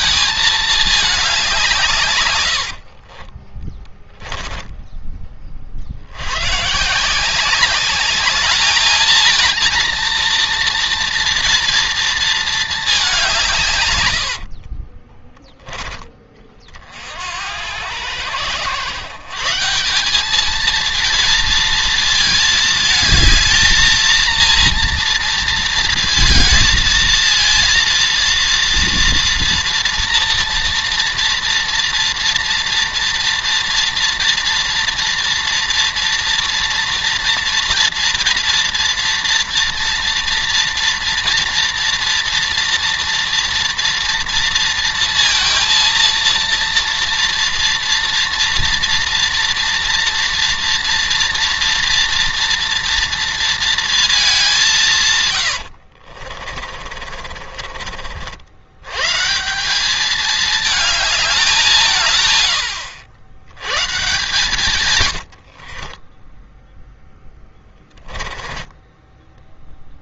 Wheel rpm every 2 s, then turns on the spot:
220, 70, 10, 130, 210, 230, 220, 50, 40, 110, 220, 220, 230, 220, 230, 240, 240, 230, 230, 230, 230, 230, 230, 230, 230, 230, 230, 180, 40, 100, 220, 90, 140, 10, 10.
2-4 14-16 56-58 64-66 68-70